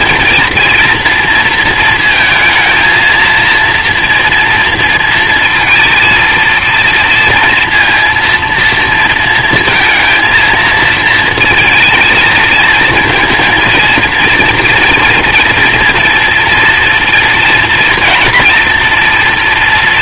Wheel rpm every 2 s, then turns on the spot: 230, 230, 230, 230, 230, 220, 220, 230, 230, 230.
none